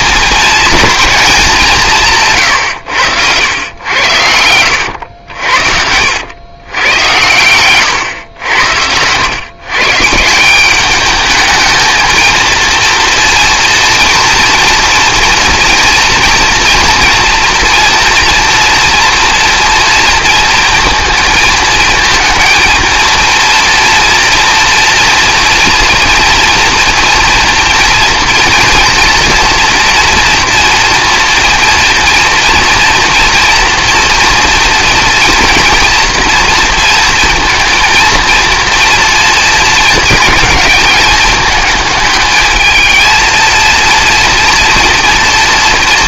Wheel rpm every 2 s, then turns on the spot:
220, 100, 80, 100, 80, 200, 230, 230, 230, 230, 230, 230, 230, 240, 230, 230, 230, 230, 230, 230, 220, 220, 240.
4-6